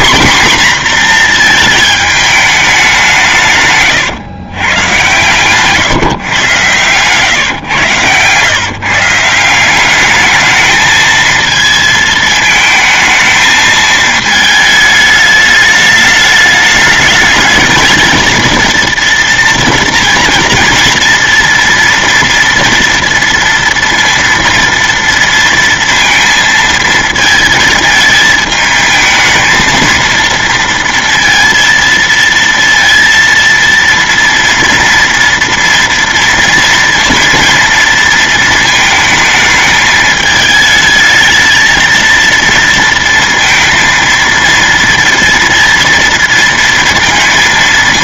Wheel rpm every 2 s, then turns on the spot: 250, 200, 120, 120, 140, 220, 220, 220, 210, 230, 230, 230, 230, 230, 220, 230, 230, 230, 230, 220, 220, 230, 230, 230.
6-8